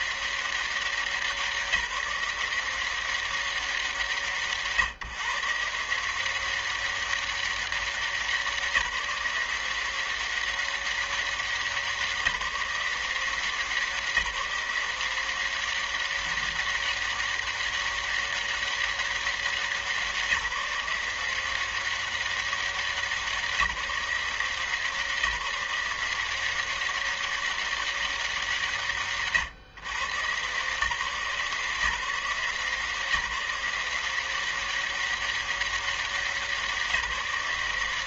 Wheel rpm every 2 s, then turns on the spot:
180, 170, 160, 170, 180, 190, 180, 180, 190, 200, 180, 190, 180, 170, 200, 130, 160, 180, 190.
none